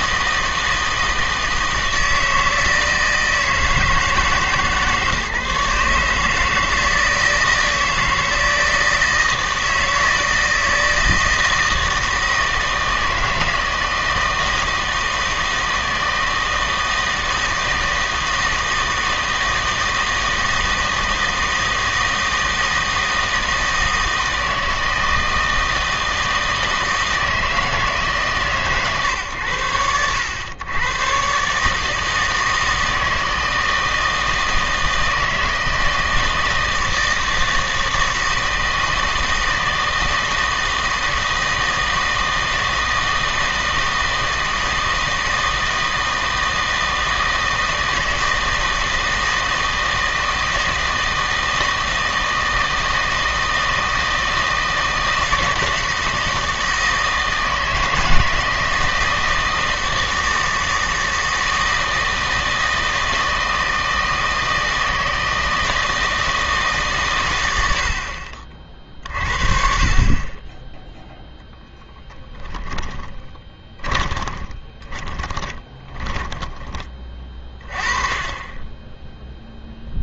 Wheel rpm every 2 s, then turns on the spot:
160, 160, 150, 160, 160, 160, 160, 160, 160, 160, 160, 160, 160, 160, 140, 110, 160, 160, 160, 160, 160, 160, 160, 160, 160, 160, 160, 160, 160, 160, 160, 160, 160, 150, 40, 10, 20, 20, 20, 10.
72-76